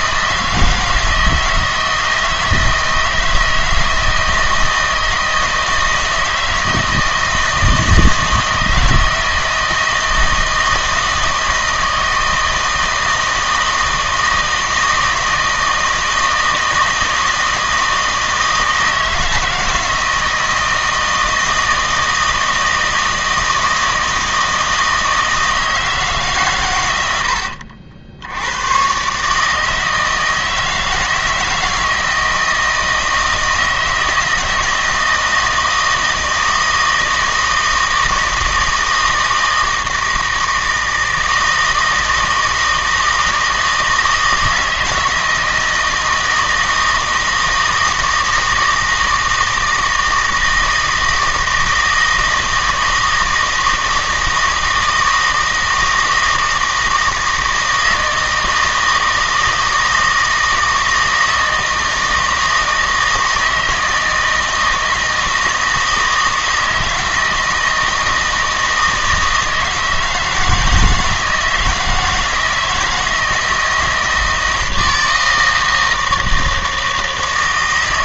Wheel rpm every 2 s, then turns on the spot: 160, 160, 160, 160, 160, 160, 160, 160, 160, 160, 160, 160, 160, 120, 110, 160, 160, 160, 160, 160, 160, 160, 160, 160, 160, 160, 160, 160, 160, 160, 160, 160, 160, 160, 160, 160, 160, 160, 160.
none